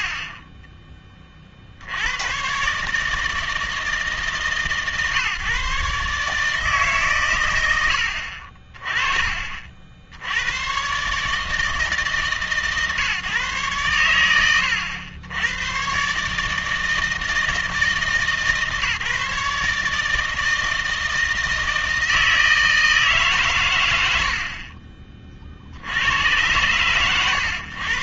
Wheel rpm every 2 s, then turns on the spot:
30, 140, 150, 150, 40, 110, 140, 90, 150, 150, 160, 160, 40, 120.
0-2